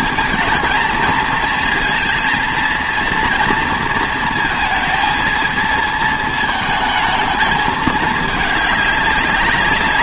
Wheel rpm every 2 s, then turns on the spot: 220, 230, 230, 220, 210.
none